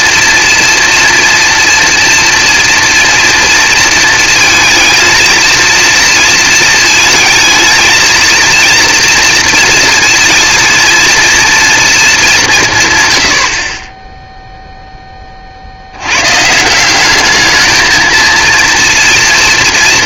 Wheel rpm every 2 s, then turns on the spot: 230, 230, 230, 220, 230, 230, 130, 10, 180, 230.
none